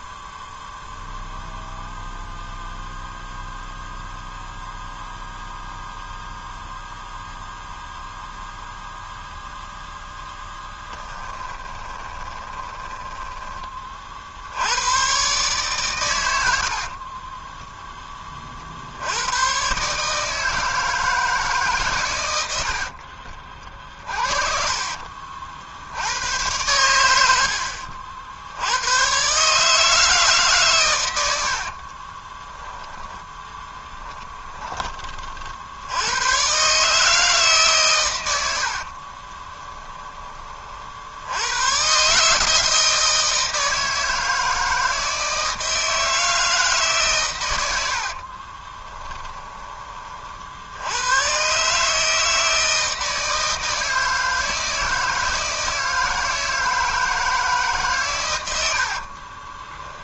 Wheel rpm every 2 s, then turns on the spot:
0, 0, 0, 0, 0, 20, 20, 100, 50, 70, 160, 70, 50, 100, 90, 130, 10, 20, 150, 60, 60, 160, 160, 150, 20, 80, 160, 160, 160, 70.
10-14 16-18 22-26 38-40 48-50 58-60